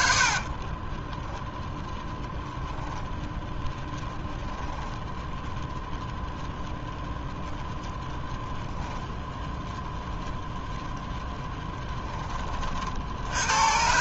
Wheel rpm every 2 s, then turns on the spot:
30, 0, 10, 0, 0, 10, 40.
0-2